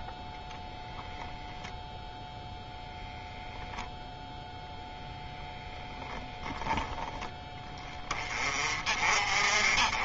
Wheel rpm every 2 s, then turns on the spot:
0, 0, 0, 10, 40.
none